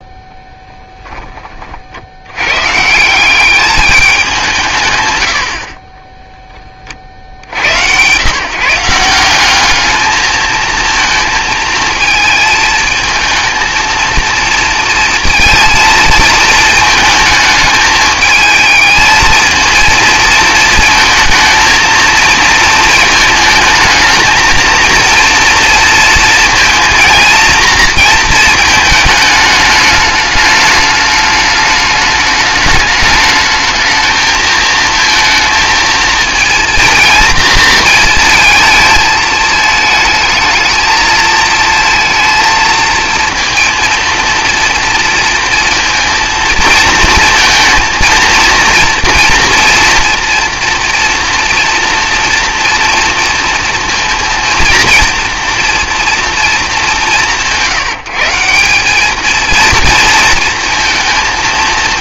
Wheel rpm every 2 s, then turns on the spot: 10, 160, 140, 30, 170, 230, 220, 230, 220, 220, 230, 220, 230, 230, 220, 210, 210, 230, 230, 220, 220, 230, 230, 230, 230, 240, 240, 230, 200, 200, 220.
none